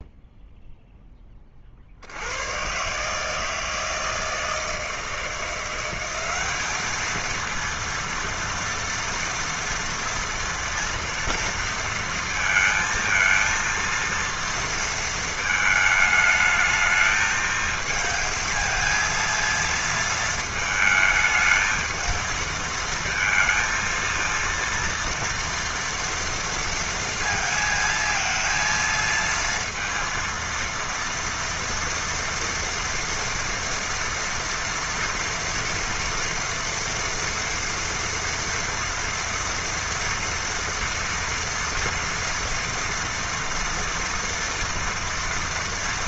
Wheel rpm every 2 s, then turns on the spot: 0, 90, 160, 190, 230, 230, 230, 230, 220, 220, 220, 230, 230, 230, 230, 230, 230, 230, 230, 240, 230, 230, 230.
none